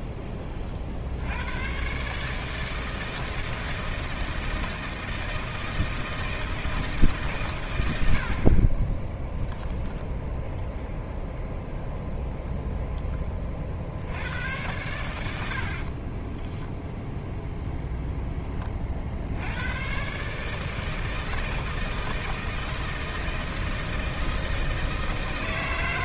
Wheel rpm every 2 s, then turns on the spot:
60, 160, 160, 160, 20, 0, 10, 90, 0, 40, 160, 160, 160.
8-10